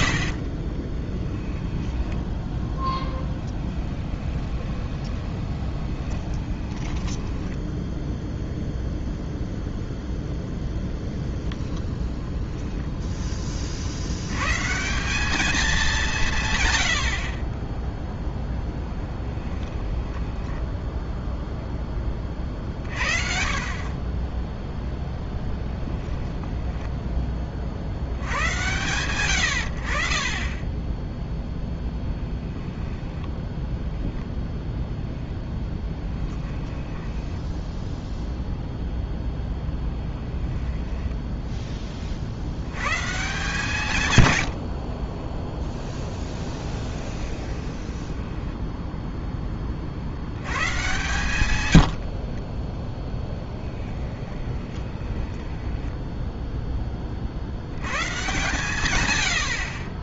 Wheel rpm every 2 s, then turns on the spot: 40, 10, 20, 20, 0, 10, 0, 150, 100, 10, 10, 50, 0, 10, 110, 10, 10, 10, 10, 0, 10, 110, 70, 10, 10, 120, 10, 20, 10, 140.
0-8 20-22 32-34 36-38 40-42 46-50 52-56